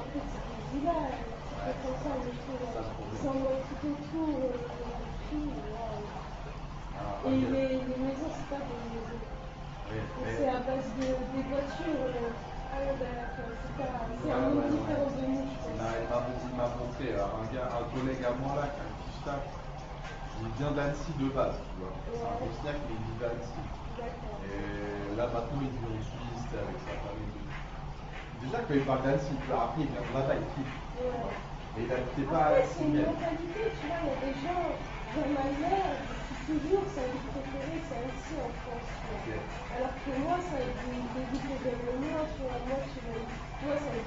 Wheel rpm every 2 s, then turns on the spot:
0, 0, 0, 0, 0, 0, 0, 0, 0, 0, 0, 0, 0, 0, 0, 0, 0, 0, 0, 0, 0, 0.
none